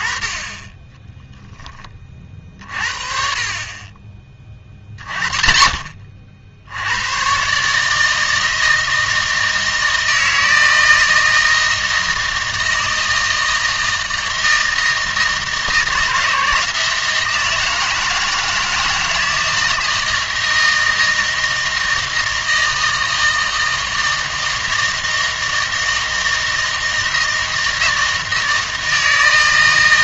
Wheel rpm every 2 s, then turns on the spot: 10, 40, 30, 80, 160, 160, 160, 160, 160, 160, 160, 160, 160, 160, 160.
none